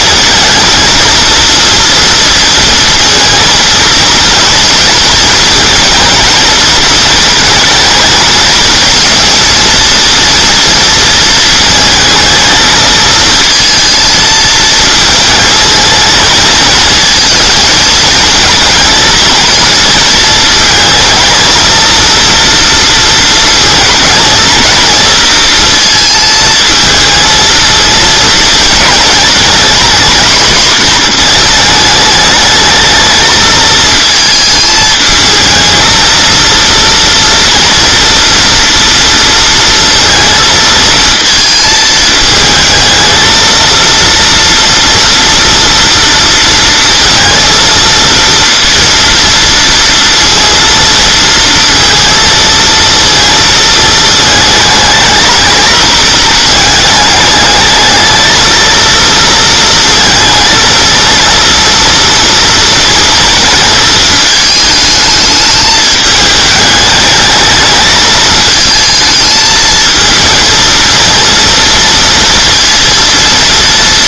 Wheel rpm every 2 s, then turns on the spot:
230, 230, 230, 230, 230, 230, 220, 220, 230, 230, 220, 230, 230, 220, 230, 240, 220, 220, 230, 230, 220, 220, 230, 230, 230, 230, 230, 220, 220, 230, 220, 230, 210, 210, 220, 230, 230.
none